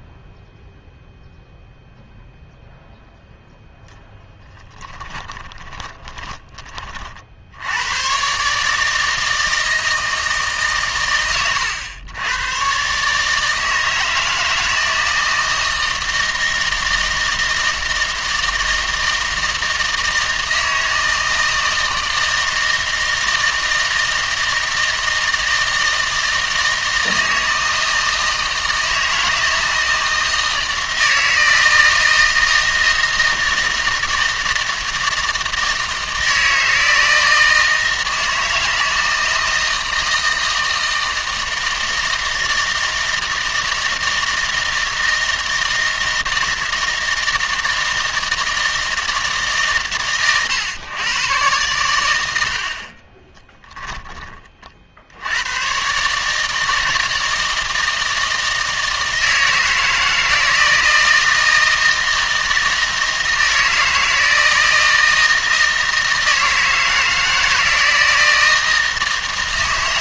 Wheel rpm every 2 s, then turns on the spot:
0, 0, 20, 20, 150, 130, 130, 160, 160, 160, 160, 160, 160, 160, 160, 160, 160, 160, 160, 160, 160, 160, 160, 160, 160, 110, 60, 50, 160, 160, 160, 160, 160, 160, 160.
4-6